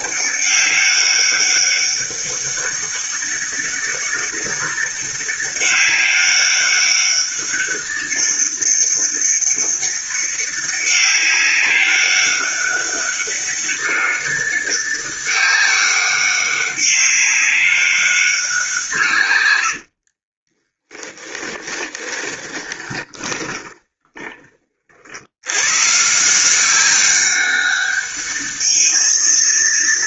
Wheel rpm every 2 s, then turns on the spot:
200, 200, 200, 200, 200, 200, 200, 200, 200, 120, 20, 20, 90, 200, 220.
18-24